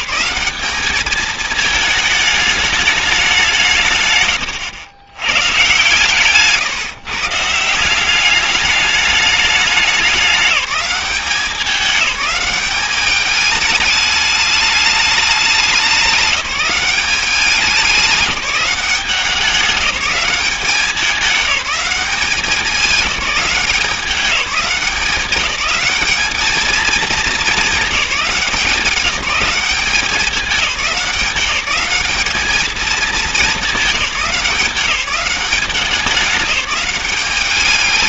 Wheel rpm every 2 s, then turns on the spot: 200, 210, 100, 150, 210, 200, 200, 210, 190, 190, 190, 200, 180, 210, 180, 200, 220, 180, 200.
none